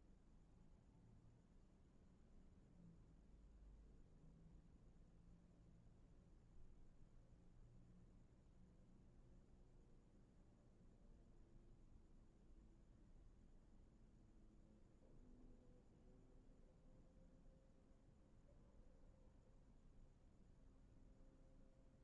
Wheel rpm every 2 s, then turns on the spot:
0, 0, 0, 0, 0, 0, 0, 0, 0, 0, 0.
none